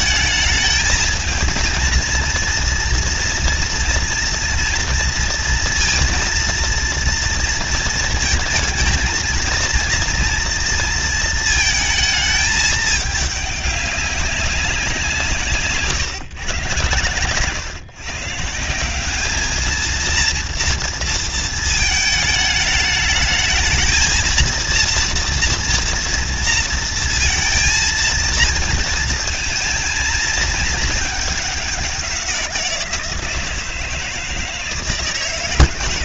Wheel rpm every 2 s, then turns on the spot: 220, 230, 230, 230, 230, 230, 210, 180, 120, 180, 230, 210, 230, 230, 220, 220, 170, 160.
none